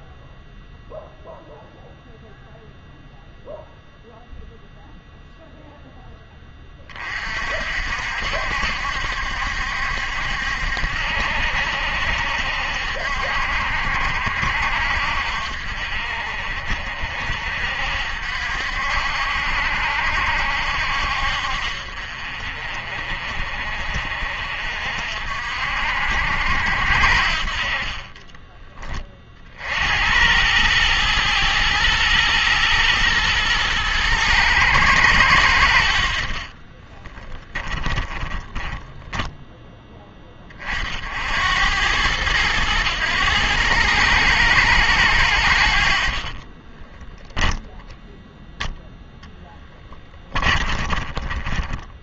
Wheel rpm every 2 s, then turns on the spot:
0, 0, 0, 20, 70, 70, 60, 60, 50, 60, 60, 40, 50, 70, 20, 100, 110, 100, 40, 10, 60, 110, 110, 30, 0, 20.
36-40 46-48 50-52